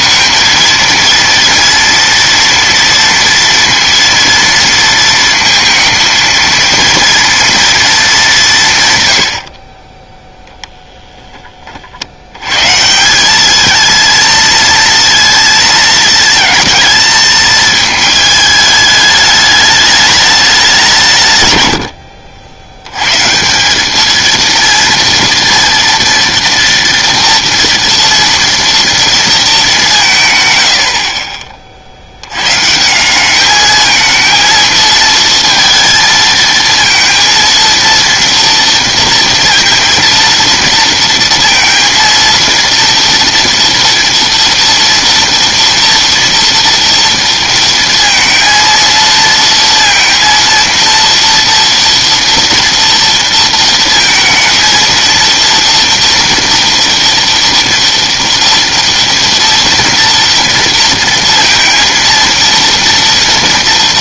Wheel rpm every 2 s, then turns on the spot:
230, 240, 230, 230, 180, 0, 120, 230, 220, 210, 200, 80, 230, 230, 230, 110, 140, 230, 220, 230, 230, 230, 230, 230, 230, 230, 230, 220, 240, 230, 230, 230.
none